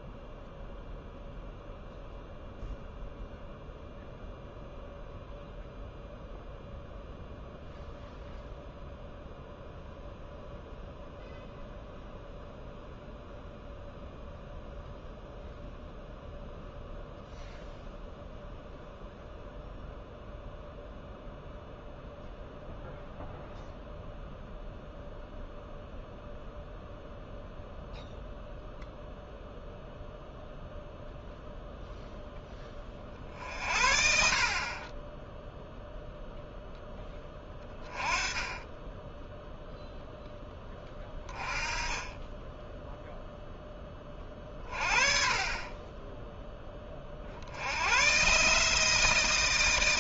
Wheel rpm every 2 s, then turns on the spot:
0, 0, 0, 0, 0, 0, 0, 0, 0, 0, 0, 0, 0, 0, 0, 0, 20, 30, 0, 10, 10, 10, 40, 10, 150.
none